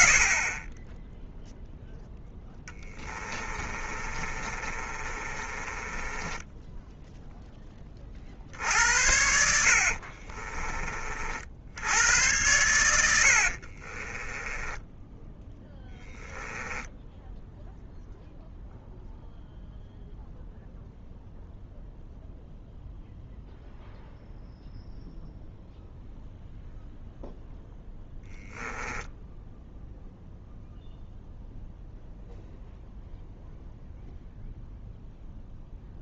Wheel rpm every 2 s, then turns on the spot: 10, 10, 30, 10, 70, 40, 90, 10, 10, 0, 0, 0, 0, 0, 10, 0, 0, 0.
2-8 14-16 28-30